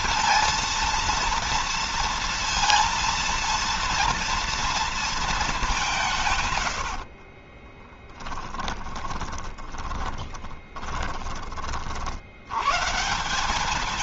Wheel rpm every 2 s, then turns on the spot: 230, 230, 230, 80, 10, 20, 130.
6-10